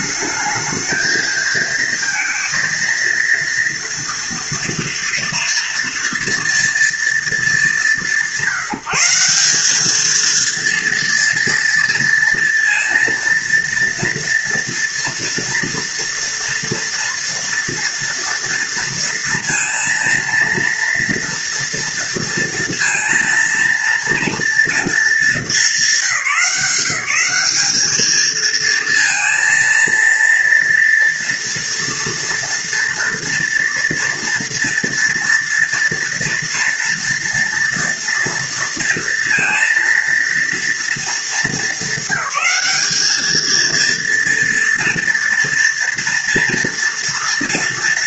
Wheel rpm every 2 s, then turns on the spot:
220, 230, 230, 230, 170, 230, 230, 240, 230, 230, 230, 230, 230, 180, 230, 230, 230, 230, 230, 230, 220, 210, 230, 230.
none